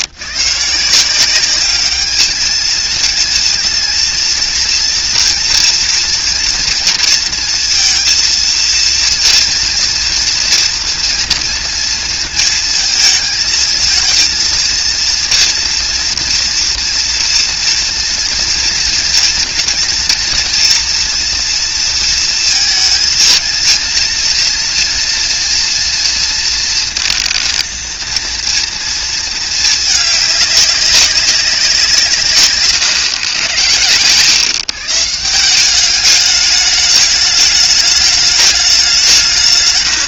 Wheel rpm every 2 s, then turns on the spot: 160, 220, 240, 230, 230, 230, 220, 230, 240, 230, 240, 220, 230, 230, 230, 200, 140, 150, 210, 190.
32-34